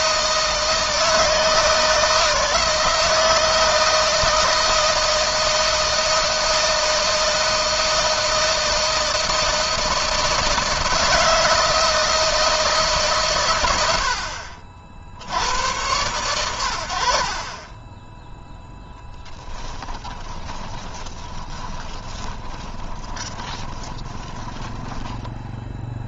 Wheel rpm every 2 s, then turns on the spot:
160, 160, 160, 160, 160, 160, 140, 70, 50, 10, 30, 20, 20.
20-24